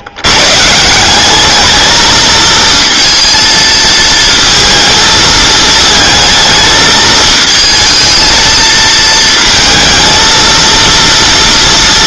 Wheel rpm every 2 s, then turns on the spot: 140, 230, 230, 220, 230, 230.
none